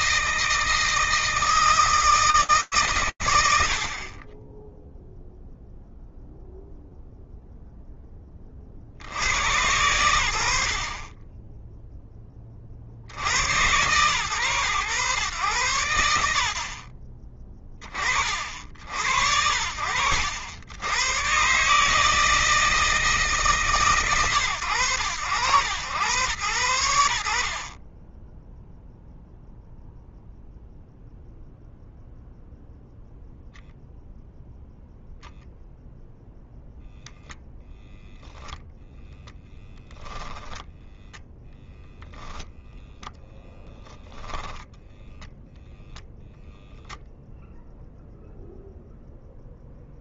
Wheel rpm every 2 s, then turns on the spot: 160, 90, 0, 0, 110, 10, 120, 100, 20, 70, 150, 150, 90, 50, 0, 0, 0, 0, 0, 0, 0, 0, 0, 0, 0.
2-4